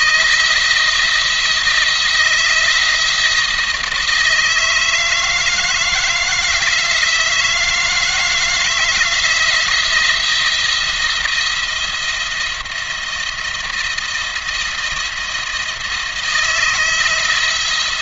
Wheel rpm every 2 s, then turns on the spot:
170, 160, 160, 160, 170, 170, 170, 170, 160.
none